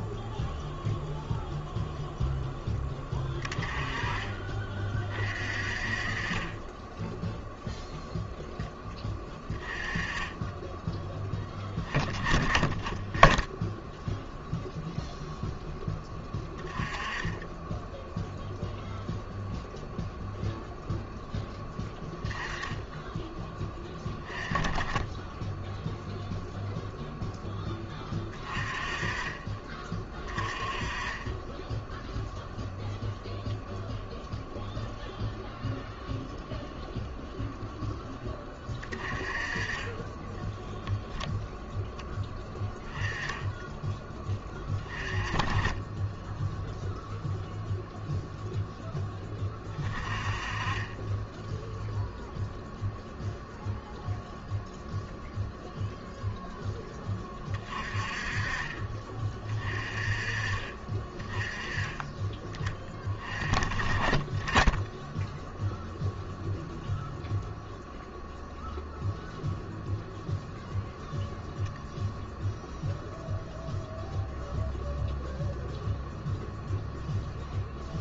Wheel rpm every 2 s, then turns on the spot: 0, 10, 30, 10, 10, 10, 20, 0, 10, 0, 0, 10, 10, 0, 20, 20, 0, 0, 0, 20, 10, 10, 20, 0, 10, 30, 0, 0, 10, 30, 30, 20, 10, 0, 0, 0, 0, 0, 0.
none